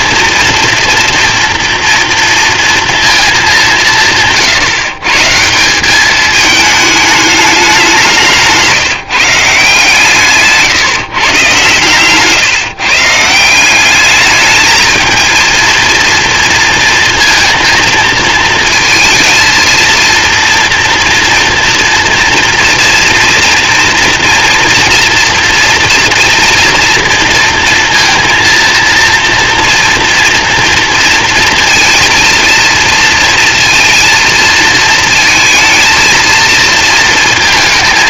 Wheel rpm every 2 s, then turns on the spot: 230, 230, 150, 220, 160, 150, 150, 220, 230, 230, 230, 230, 230, 230, 230, 230, 230, 230, 230.
8-10